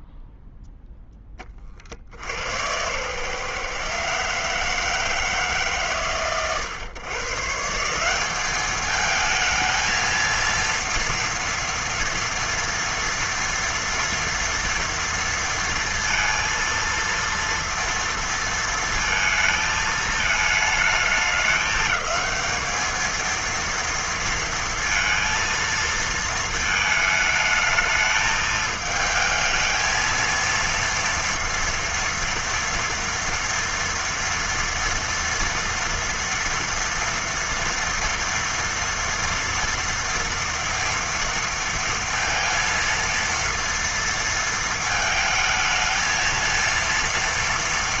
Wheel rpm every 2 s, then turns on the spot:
0, 80, 150, 130, 190, 230, 230, 230, 230, 230, 220, 210, 230, 220, 220, 230, 230, 230, 230, 230, 240, 230, 230, 220.
none